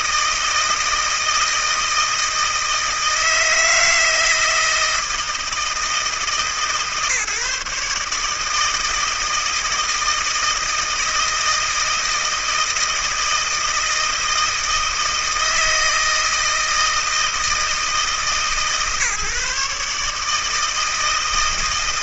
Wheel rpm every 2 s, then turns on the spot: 160, 160, 160, 150, 160, 160, 160, 160, 160, 150, 160.
none